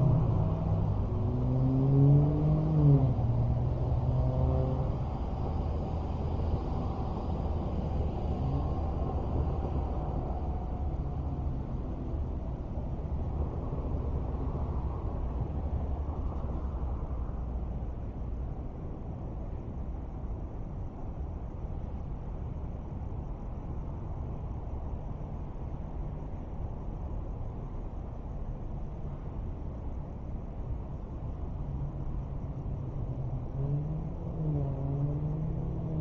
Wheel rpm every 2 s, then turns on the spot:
0, 0, 0, 0, 0, 0, 0, 0, 0, 0, 0, 0, 0, 0, 0, 0, 0, 0.
none